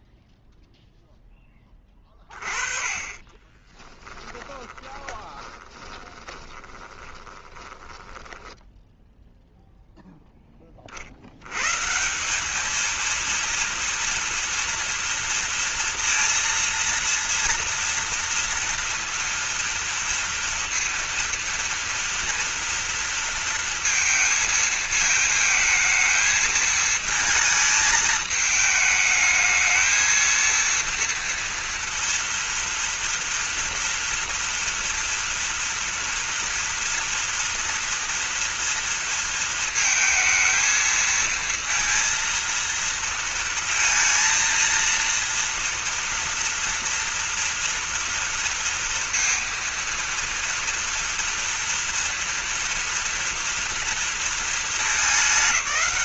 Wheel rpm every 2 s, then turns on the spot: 0, 30, 20, 20, 10, 40, 220, 230, 230, 230, 230, 230, 220, 220, 210, 230, 230, 230, 230, 230, 230, 230, 230, 230, 230, 230, 230, 200.
2-10